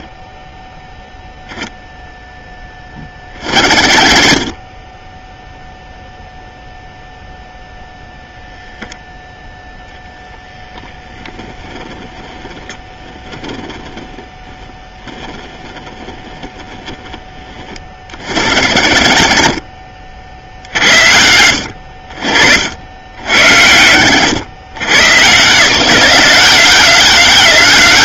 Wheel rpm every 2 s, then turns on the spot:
0, 30, 20, 0, 0, 10, 10, 10, 10, 50, 60, 70, 110, 180.
none